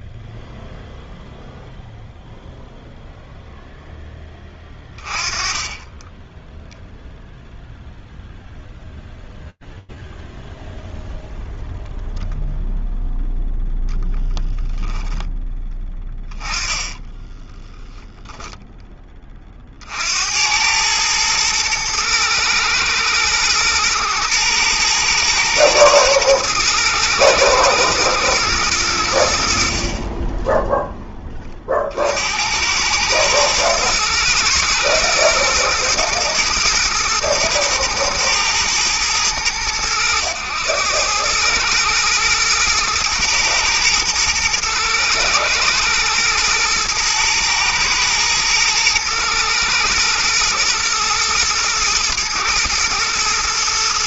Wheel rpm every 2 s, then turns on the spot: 0, 0, 20, 0, 0, 0, 0, 20, 20, 20, 110, 110, 120, 110, 90, 10, 110, 110, 110, 110, 100, 110, 120, 110, 110, 120, 120.
14-18